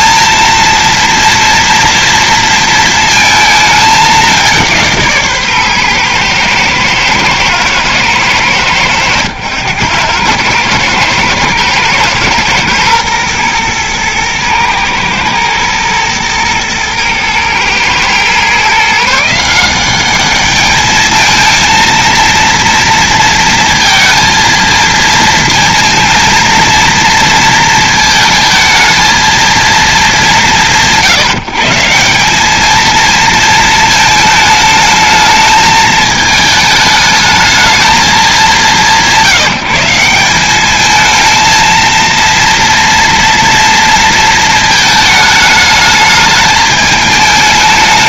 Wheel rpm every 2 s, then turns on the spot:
230, 230, 170, 110, 90, 110, 120, 110, 110, 140, 210, 230, 230, 230, 220, 140, 220, 220, 220, 160, 210, 240, 220, 220.
none